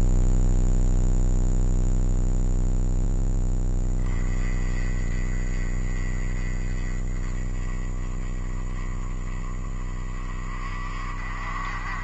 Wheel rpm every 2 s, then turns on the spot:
0, 0, 20, 20, 20, 40.
none